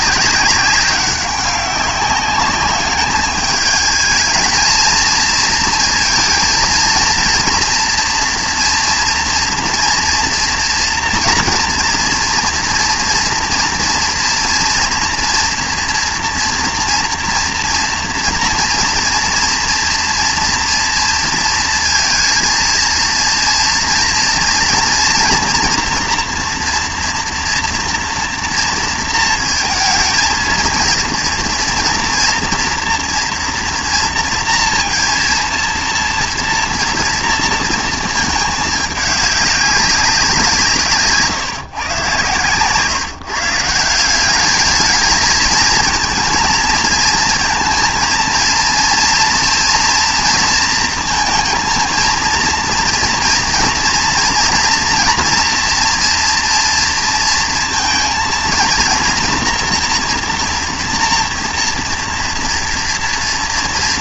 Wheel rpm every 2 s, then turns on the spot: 190, 200, 230, 220, 230, 230, 230, 230, 230, 230, 230, 230, 230, 240, 230, 230, 240, 230, 230, 210, 160, 130, 210, 230, 230, 230, 230, 230, 230, 230, 230, 230.
none